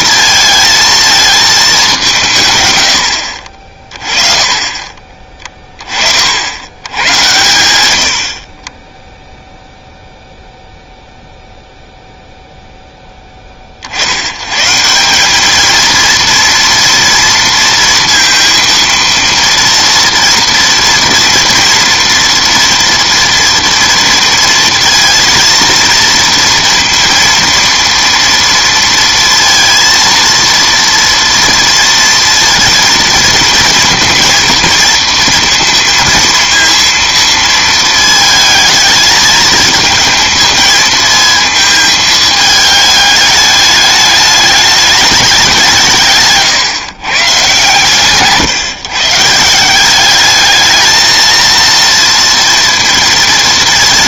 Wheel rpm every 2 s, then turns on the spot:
230, 140, 30, 80, 30, 0, 0, 110, 230, 230, 230, 240, 230, 230, 230, 230, 230, 230, 230, 220, 230, 210, 210, 140, 150, 210, 230.
46-48